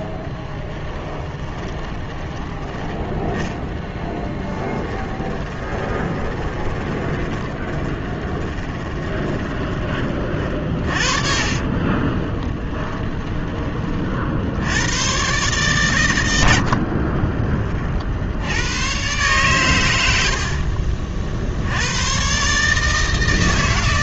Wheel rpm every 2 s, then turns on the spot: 20, 10, 10, 20, 20, 40, 30, 100, 50, 110, 50, 150.
0-2 4-14 16-18 20-22